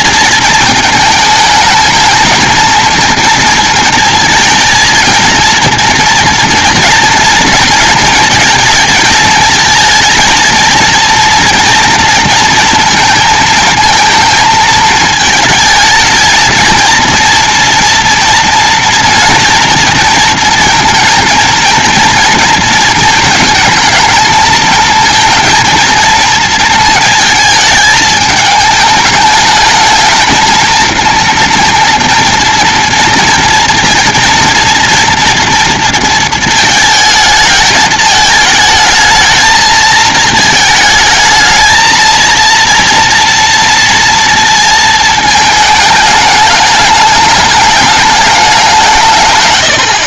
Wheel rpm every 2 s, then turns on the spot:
220, 220, 230, 230, 230, 230, 230, 220, 230, 240, 230, 230, 220, 220, 220, 220, 240, 230, 220, 220, 220, 230, 230, 210, 190.
none